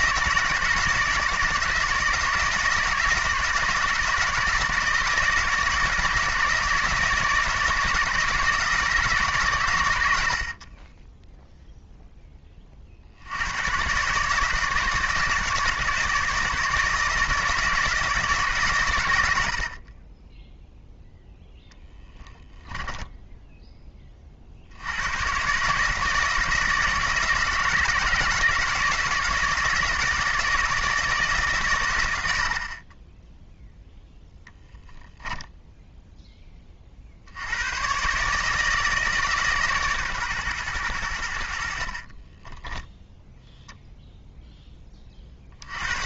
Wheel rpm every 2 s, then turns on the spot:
160, 160, 160, 160, 160, 30, 50, 160, 160, 120, 0, 10, 90, 160, 160, 160, 40, 0, 50, 150, 90, 10, 30.
22-24 32-34 42-44